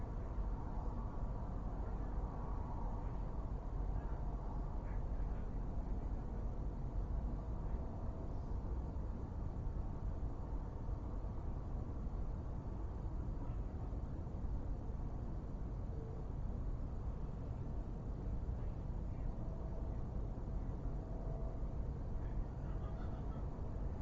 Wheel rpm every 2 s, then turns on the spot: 0, 0, 0, 0, 0, 0, 0, 0, 0, 0, 0, 0.
none